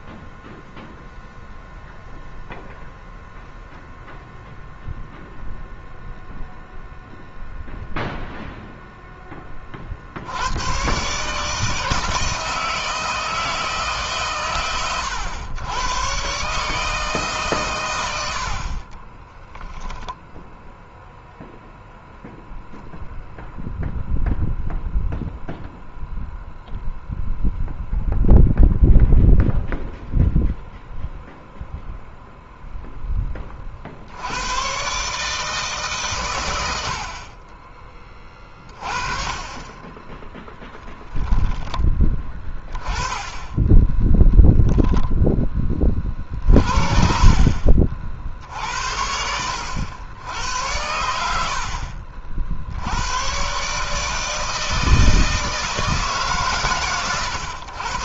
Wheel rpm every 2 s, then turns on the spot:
0, 0, 0, 0, 0, 120, 160, 120, 150, 40, 0, 0, 0, 0, 0, 0, 0, 120, 90, 30, 10, 30, 10, 50, 80, 80, 70, 160, 130.
18-20